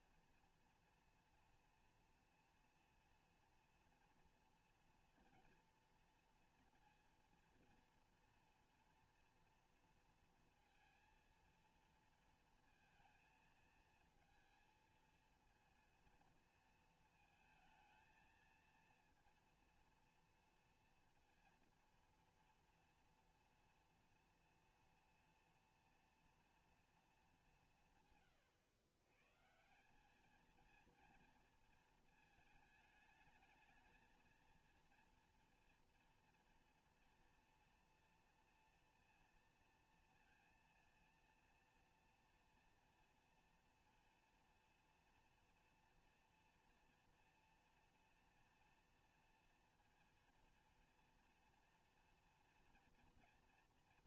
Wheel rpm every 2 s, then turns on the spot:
230, 230, 230, 230, 230, 230, 230, 220, 220, 230, 230, 230, 240, 240, 110, 210, 220, 230, 230, 230, 230, 230, 230, 230, 230, 230, 230.
none